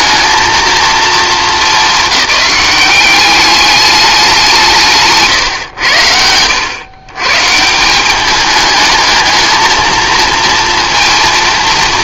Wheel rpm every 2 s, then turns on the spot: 230, 200, 170, 100, 210, 230.
none